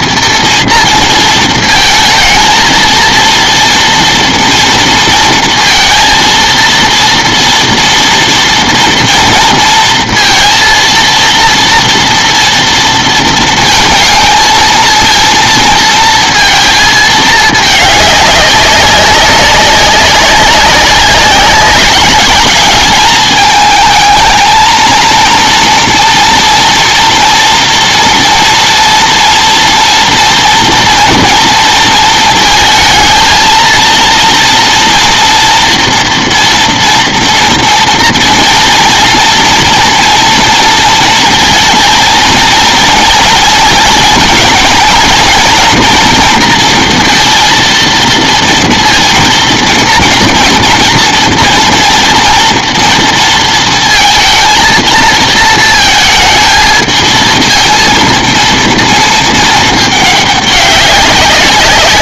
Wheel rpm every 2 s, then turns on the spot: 230, 230, 230, 230, 230, 230, 240, 230, 220, 190, 200, 210, 220, 230, 230, 240, 220, 230, 230, 230, 230, 230, 230, 240, 230, 230, 230, 230, 220, 230, 200.
none